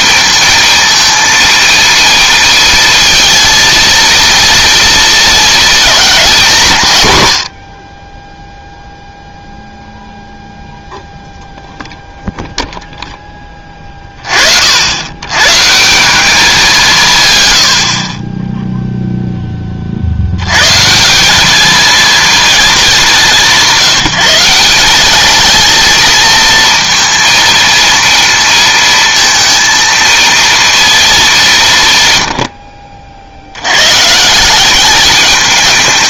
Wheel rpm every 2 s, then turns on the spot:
220, 220, 230, 190, 0, 0, 0, 60, 180, 10, 120, 210, 180, 230, 230, 230, 70, 190.
none